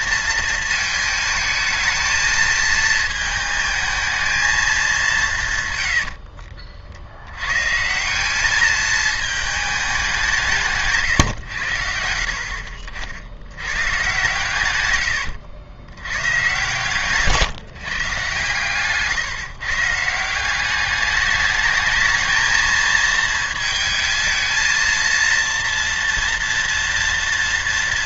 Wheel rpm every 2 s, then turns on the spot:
220, 220, 210, 60, 220, 160, 60, 120, 140, 140, 190, 220, 230, 230.
none